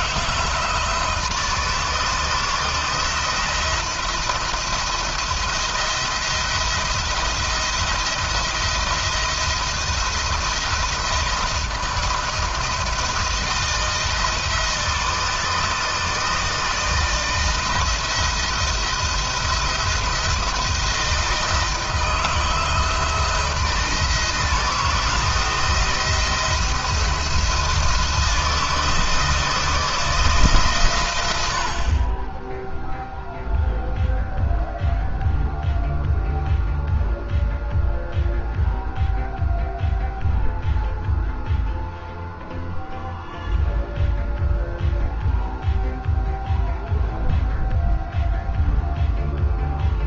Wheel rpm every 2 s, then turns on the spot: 170, 170, 170, 170, 170, 170, 170, 160, 160, 170, 160, 170, 160, 170, 160, 140, 10, 0, 0, 0, 0, 0, 0, 0, 0.
none